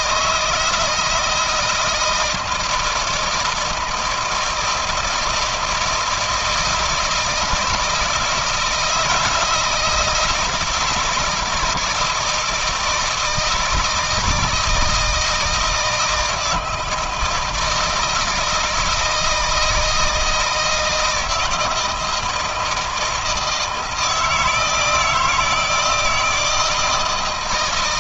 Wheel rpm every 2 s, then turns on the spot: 160, 160, 160, 160, 160, 170, 160, 160, 160, 160, 160, 160, 160, 160.
none